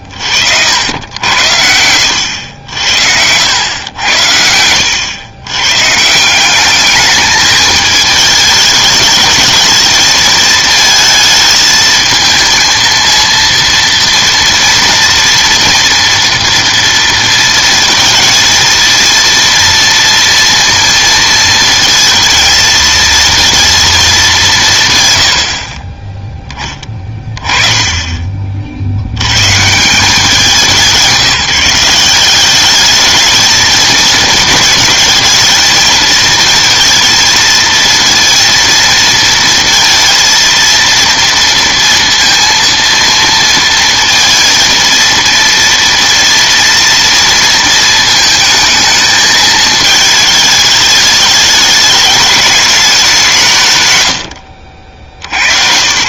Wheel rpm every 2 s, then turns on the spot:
60, 80, 90, 200, 210, 220, 230, 230, 230, 230, 230, 230, 170, 10, 60, 180, 200, 220, 220, 230, 230, 230, 230, 230, 220, 210, 210, 50.
4-6